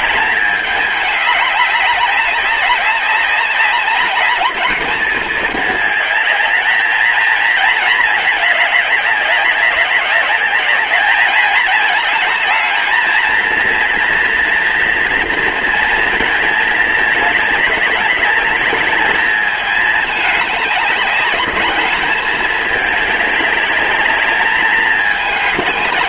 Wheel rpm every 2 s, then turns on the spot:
210, 200, 210, 220, 200, 210, 230, 230, 210, 210, 200, 200, 210.
none